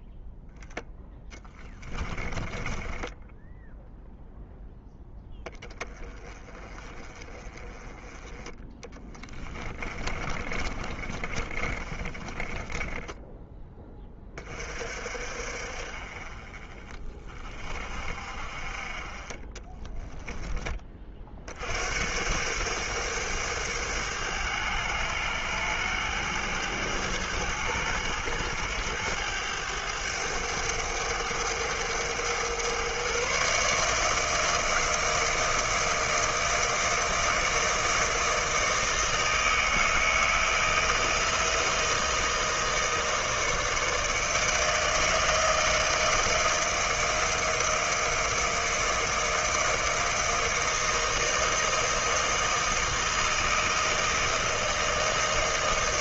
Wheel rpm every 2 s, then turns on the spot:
0, 20, 0, 20, 20, 30, 20, 40, 30, 30, 20, 100, 100, 110, 100, 100, 120, 160, 160, 160, 160, 160, 160, 160, 160, 160, 160, 160.
2-4 8-14